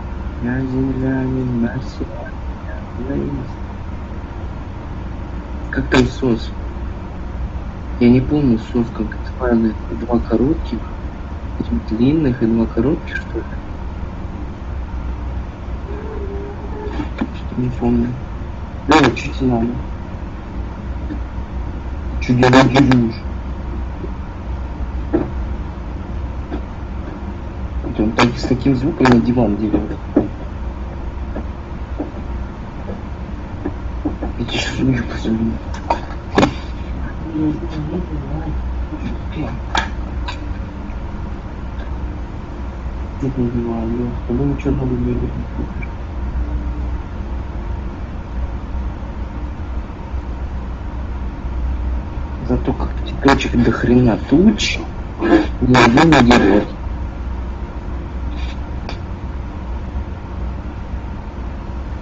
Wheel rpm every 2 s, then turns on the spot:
0, 0, 0, 0, 0, 0, 0, 0, 0, 0, 0, 0, 0, 0, 0, 0, 0, 0, 0, 0, 0, 0, 0, 0, 0, 0, 0, 0, 0, 0, 0.
none